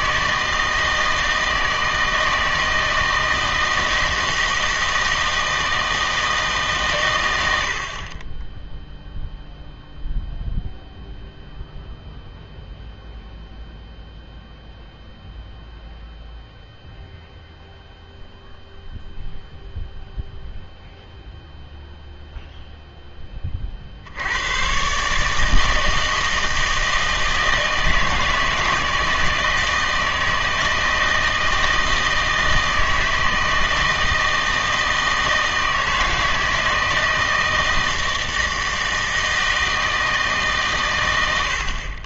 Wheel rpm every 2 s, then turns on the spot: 160, 160, 160, 140, 0, 0, 0, 0, 0, 0, 0, 0, 130, 160, 160, 160, 160, 160, 160, 160, 130.
none